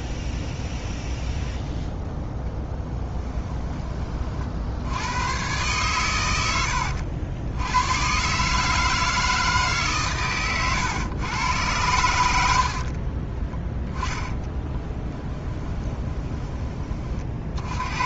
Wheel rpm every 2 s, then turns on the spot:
10, 10, 80, 80, 160, 110, 50, 10, 30.
2-4 14-16